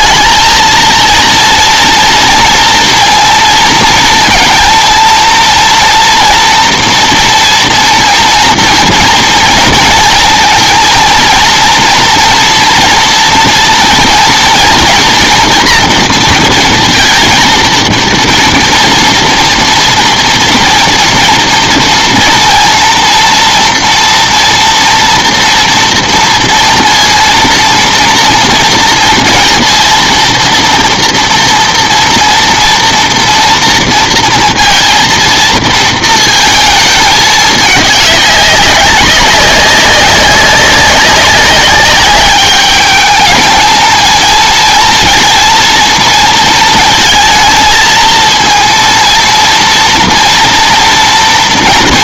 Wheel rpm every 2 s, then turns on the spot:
230, 230, 230, 230, 230, 230, 230, 230, 230, 230, 230, 230, 230, 230, 230, 230, 230, 230, 220, 200, 190, 200, 220, 230, 230, 230.
none